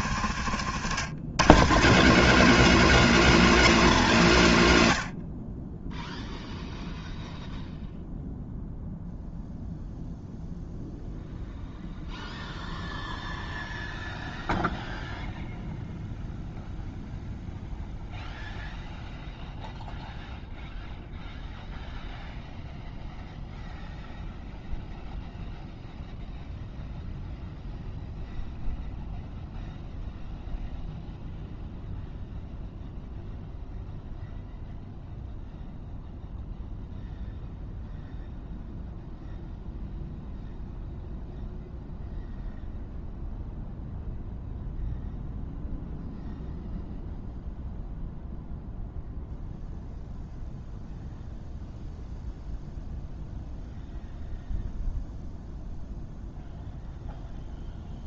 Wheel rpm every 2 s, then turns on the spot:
100, 210, 110, 0, 0, 0, 0, 0, 0, 0, 0, 0, 0, 0, 0, 0, 0, 0, 0, 0, 0, 0, 0, 0, 0, 0, 0, 0, 0.
0-2